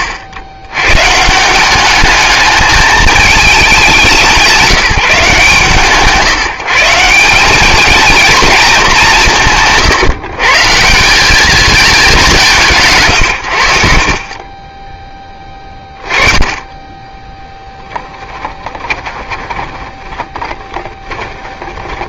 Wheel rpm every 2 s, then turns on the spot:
80, 220, 180, 140, 220, 140, 140, 20, 20, 20, 20.
16-22